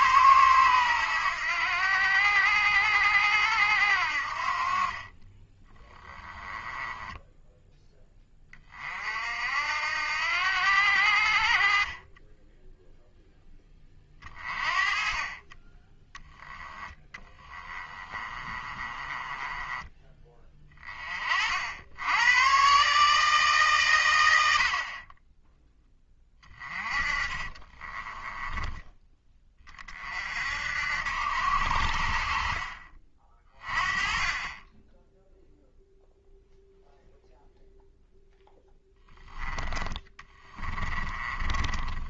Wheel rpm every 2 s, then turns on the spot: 100, 80, 40, 10, 40, 80, 0, 30, 10, 20, 30, 130, 50, 30, 10, 70, 40, 10, 0, 10, 20.
6-8 16-20 26-28 40-42